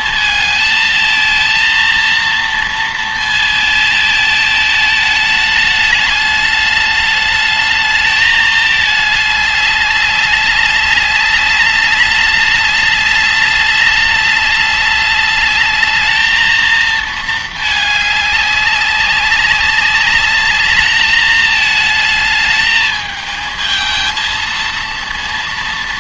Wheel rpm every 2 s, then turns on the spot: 220, 230, 220, 210, 210, 200, 200, 200, 220, 200, 210, 220, 230.
none